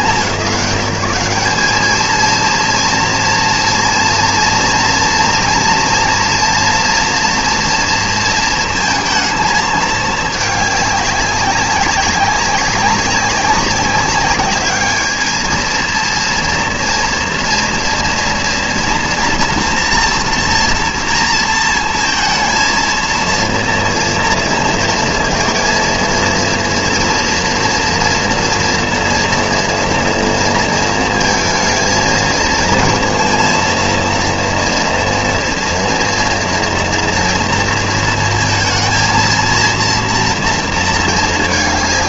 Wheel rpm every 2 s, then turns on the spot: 170, 230, 230, 240, 230, 210, 190, 210, 230, 240, 230, 230, 230, 230, 230, 230, 230, 230, 240, 230, 230.
none